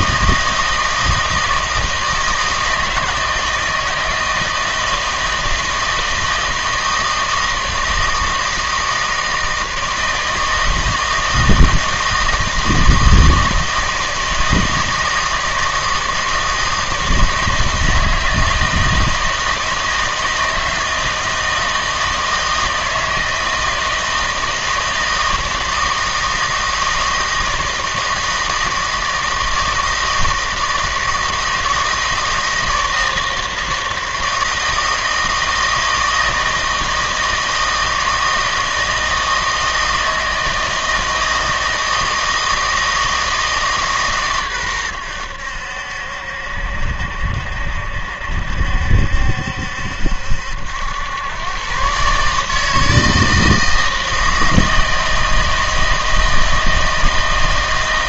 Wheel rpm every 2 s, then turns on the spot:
160, 160, 160, 160, 160, 160, 160, 160, 160, 160, 160, 160, 160, 160, 160, 160, 160, 160, 160, 160, 160, 160, 110, 70, 70, 80, 160, 160, 160.
none